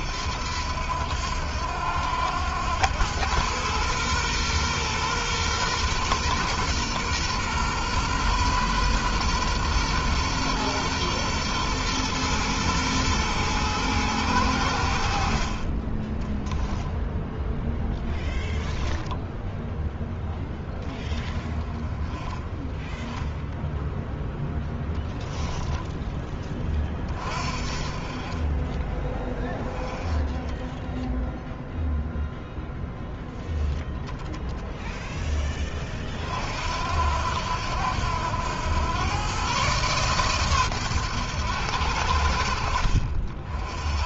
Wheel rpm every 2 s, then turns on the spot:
80, 90, 120, 120, 120, 120, 120, 90, 10, 10, 10, 10, 0, 20, 20, 10, 0, 10, 60, 100, 120, 60.
16-18